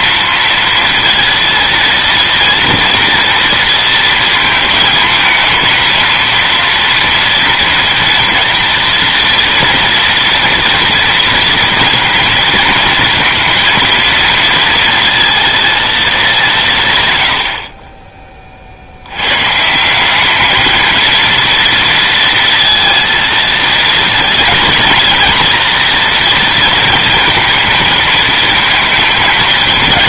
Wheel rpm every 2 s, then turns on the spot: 230, 230, 230, 230, 240, 230, 230, 230, 130, 70, 220, 230, 230, 230, 230.
none